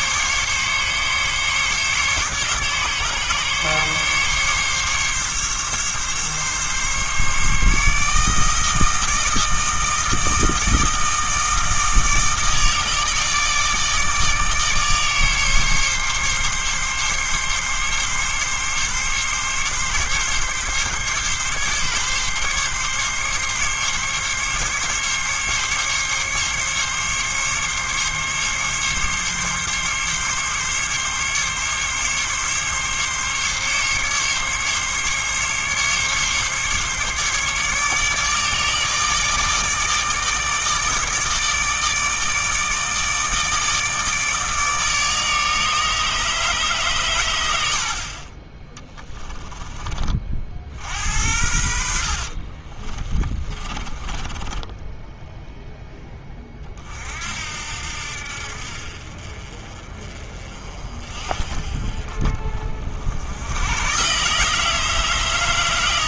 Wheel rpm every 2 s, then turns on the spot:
140, 140, 140, 140, 160, 160, 160, 150, 140, 140, 140, 140, 140, 140, 140, 140, 140, 140, 140, 150, 150, 150, 150, 140, 20, 50, 30, 10, 40, 50, 40, 50, 160.
48-50 52-56